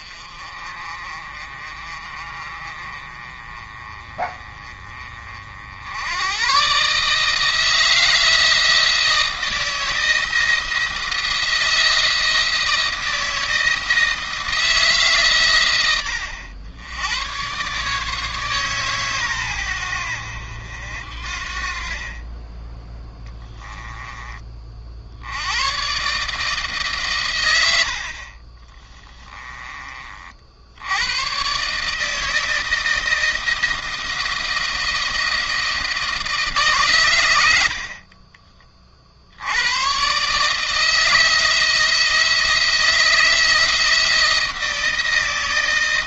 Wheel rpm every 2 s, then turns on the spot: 40, 30, 30, 130, 160, 170, 160, 150, 80, 140, 70, 20, 40, 140, 30, 70, 160, 170, 150, 30, 150, 170, 160.
28-30